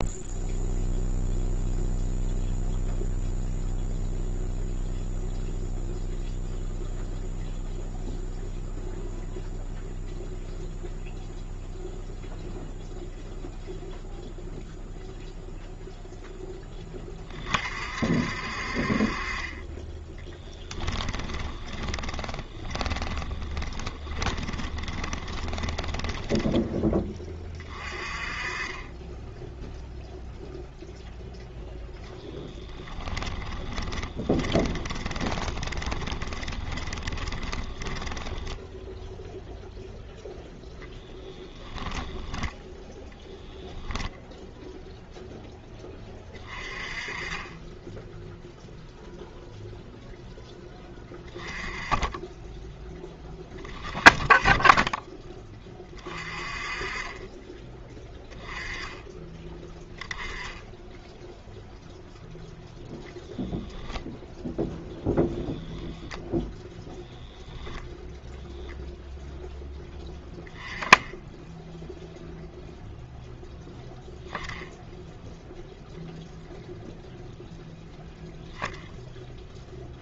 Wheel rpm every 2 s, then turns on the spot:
0, 0, 0, 0, 0, 0, 0, 0, 10, 50, 10, 20, 20, 10, 20, 0, 10, 20, 10, 0, 0, 0, 0, 30, 0, 10, 10, 10, 30, 10, 10, 0, 0, 0, 0, 10, 0, 0, 0, 0.
20-26 32-38